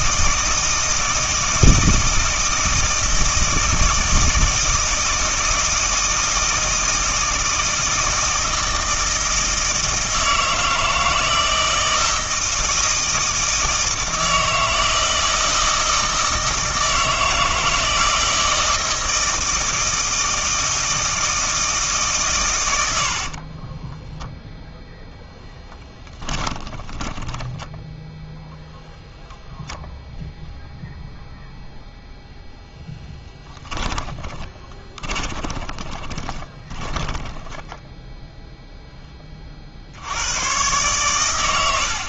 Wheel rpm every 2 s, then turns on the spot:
160, 160, 160, 160, 160, 160, 160, 160, 160, 160, 160, 90, 0, 20, 0, 0, 10, 30, 20, 0, 120.
26-28 34-38